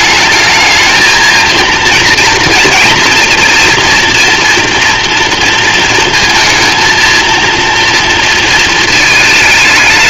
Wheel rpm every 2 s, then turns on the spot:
220, 230, 230, 230, 220.
none